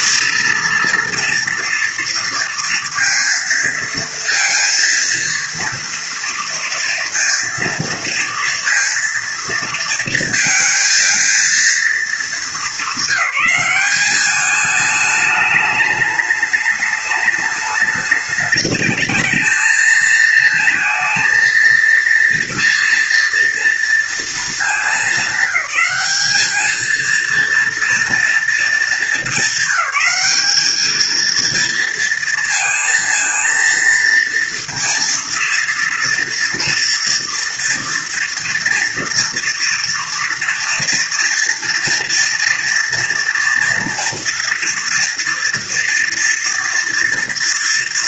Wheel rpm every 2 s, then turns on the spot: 230, 230, 230, 230, 230, 230, 220, 200, 210, 210, 220, 230, 220, 220, 230, 200, 230, 230, 230, 230, 230, 230, 230, 230.
none